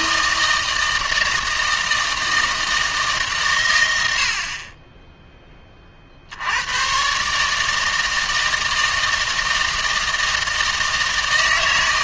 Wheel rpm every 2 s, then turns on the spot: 160, 160, 20, 110, 160, 160.
none